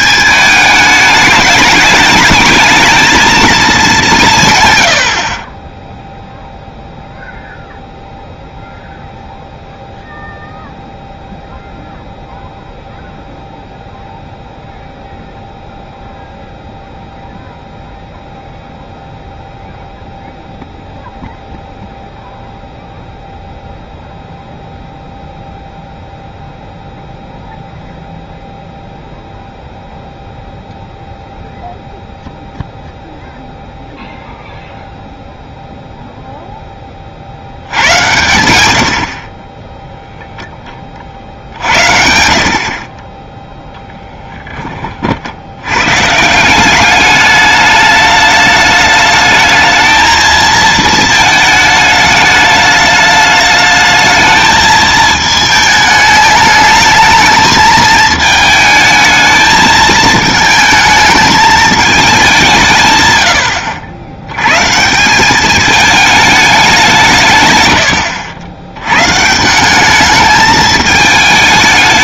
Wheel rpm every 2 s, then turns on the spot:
210, 220, 100, 0, 0, 0, 0, 0, 0, 0, 0, 0, 0, 0, 0, 0, 0, 0, 20, 70, 30, 40, 30, 190, 210, 220, 210, 220, 220, 220, 220, 150, 140, 180, 110, 210.
none